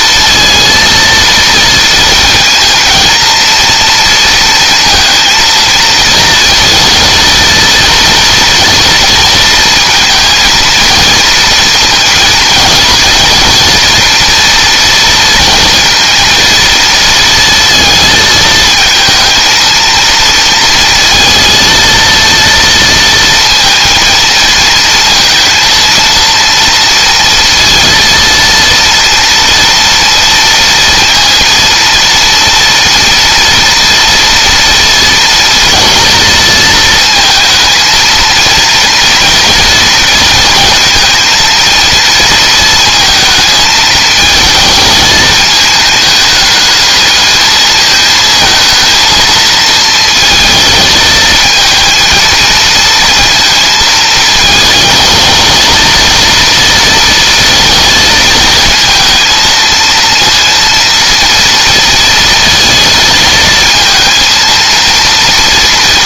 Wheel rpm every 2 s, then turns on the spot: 230, 230, 230, 230, 230, 230, 230, 230, 230, 220, 230, 230, 230, 230, 230, 230, 230, 230, 220, 230, 230, 220, 220, 210, 230, 220, 230, 220, 230, 230, 230, 230, 230.
none